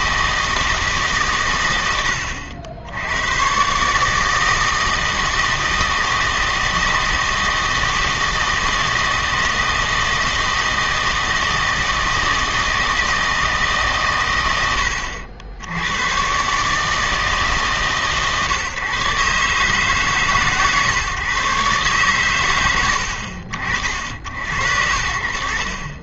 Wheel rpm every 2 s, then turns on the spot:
160, 80, 160, 160, 160, 160, 160, 100, 150, 130, 150, 90, 80.
none